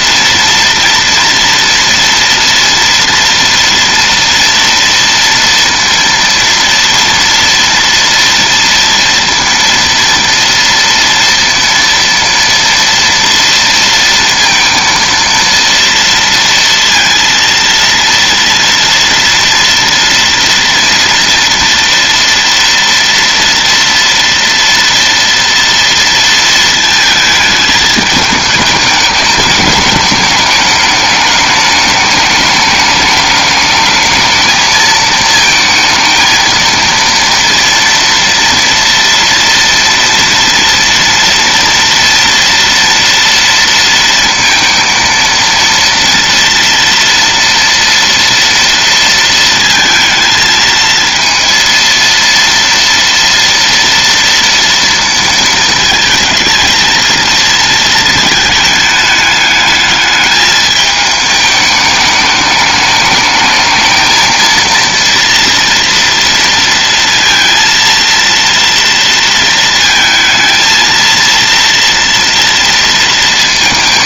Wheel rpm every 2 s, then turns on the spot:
230, 230, 230, 230, 230, 230, 230, 230, 230, 230, 230, 230, 230, 230, 210, 210, 210, 220, 230, 230, 240, 230, 230, 230, 230, 230, 230, 230, 220, 220, 210, 210, 230, 230, 230, 220, 230.
none